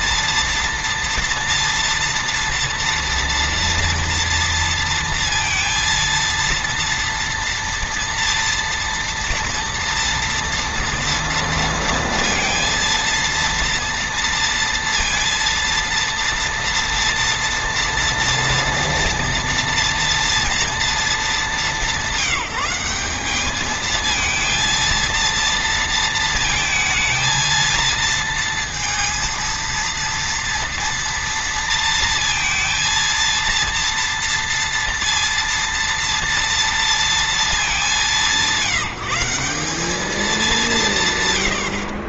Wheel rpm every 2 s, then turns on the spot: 230, 230, 230, 230, 230, 230, 230, 230, 230, 230, 230, 200, 230, 230, 230, 230, 230, 230, 230, 180, 160.
none